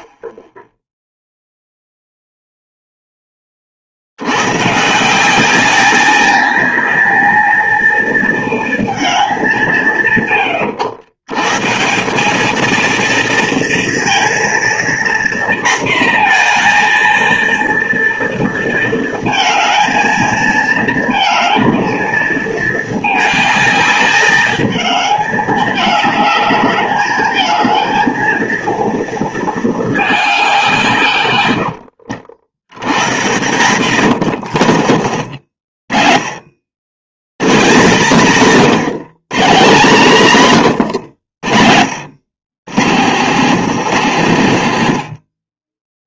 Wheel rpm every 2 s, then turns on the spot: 0, 0, 130, 220, 220, 100, 220, 240, 230, 230, 220, 220, 210, 210, 230, 170, 100, 90, 80, 160, 130, 100, 100.
34-36 44-46